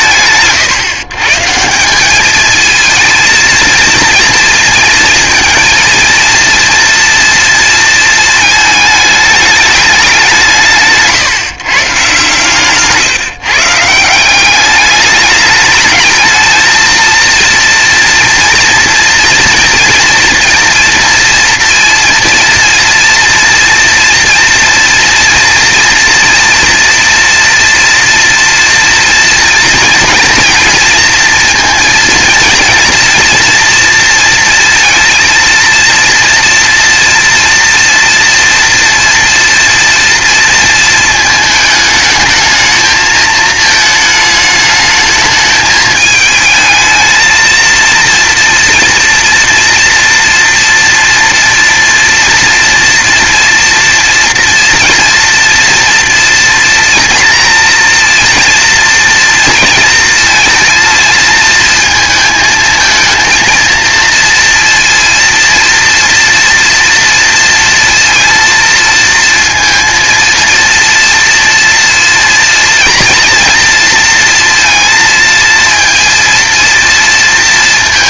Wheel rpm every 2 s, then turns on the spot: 130, 220, 230, 230, 220, 160, 140, 200, 230, 230, 240, 230, 240, 230, 230, 240, 230, 230, 230, 230, 220, 220, 220, 220, 230, 230, 230, 230, 240, 240, 230, 220, 230, 230, 230, 230, 230, 230, 240.
12-14